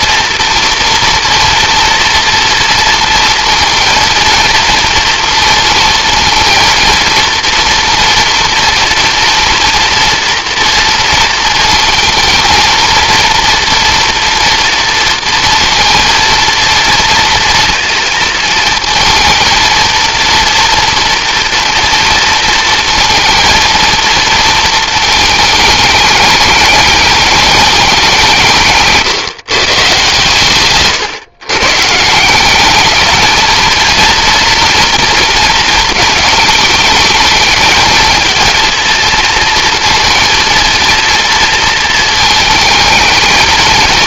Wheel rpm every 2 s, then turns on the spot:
230, 230, 230, 230, 240, 230, 220, 230, 230, 230, 230, 230, 220, 210, 160, 140, 200, 230, 210, 230, 230, 220.
none